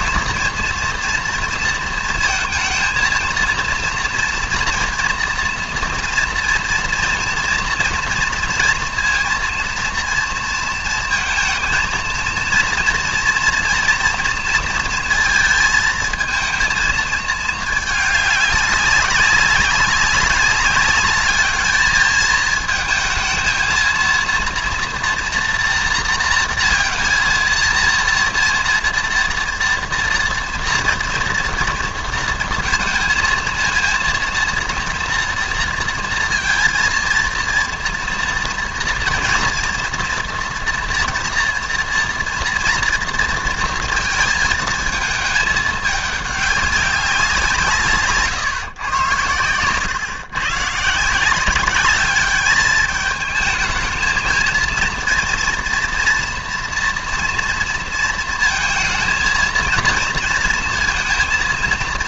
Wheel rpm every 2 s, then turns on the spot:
230, 220, 230, 240, 230, 230, 230, 230, 220, 200, 200, 220, 230, 230, 230, 240, 230, 230, 230, 230, 240, 230, 220, 200, 120, 150, 210, 230, 230, 230, 230.
none